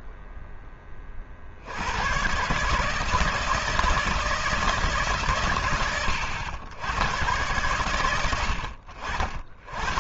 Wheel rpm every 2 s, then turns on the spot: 30, 150, 150, 100, 60.
none